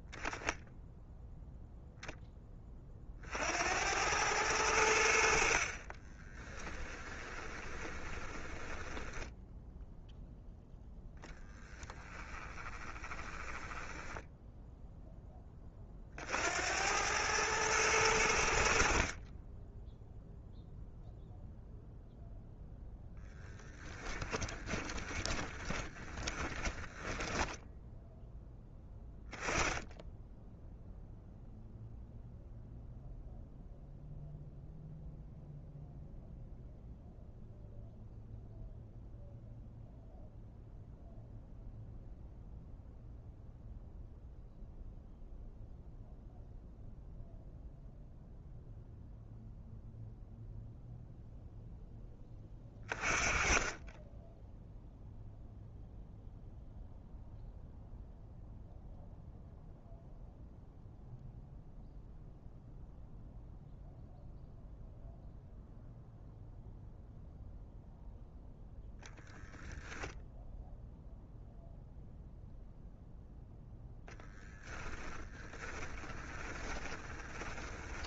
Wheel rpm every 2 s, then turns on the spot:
0, 30, 80, 10, 10, 0, 20, 0, 90, 50, 0, 10, 20, 20, 10, 0, 0, 0, 0, 0, 0, 0, 0, 0, 0, 0, 30, 0, 0, 0, 0, 0, 0, 0, 0, 0, 0, 20, 30.
6-10 12-14 24-28 74-78